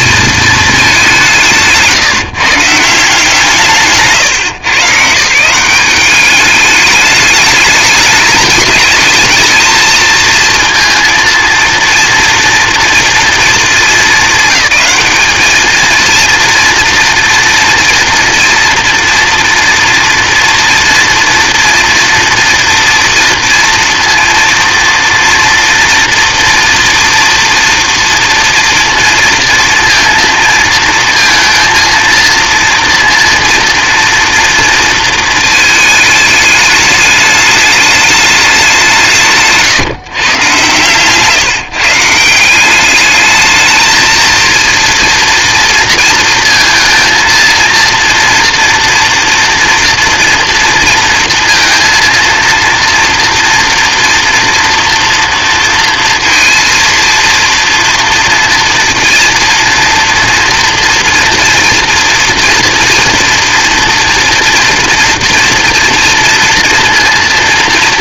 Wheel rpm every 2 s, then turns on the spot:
210, 170, 140, 200, 210, 230, 240, 200, 230, 230, 230, 230, 230, 230, 230, 230, 230, 230, 210, 190, 130, 190, 230, 230, 230, 230, 230, 230, 230, 230, 230, 230, 240, 230.
none